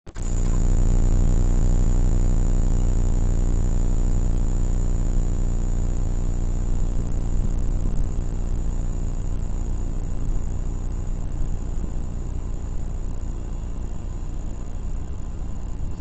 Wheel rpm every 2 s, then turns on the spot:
0, 0, 0, 0, 0, 0, 0, 0.
none